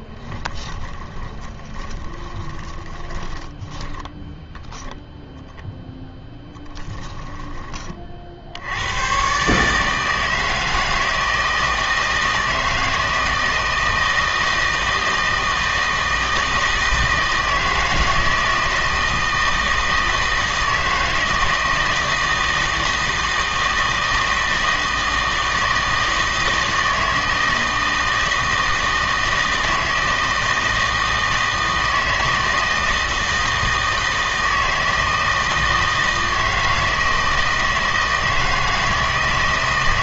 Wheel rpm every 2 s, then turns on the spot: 10, 20, 0, 10, 80, 160, 160, 160, 160, 160, 160, 160, 160, 160, 160, 160, 160, 160, 160, 160.
0-4 6-8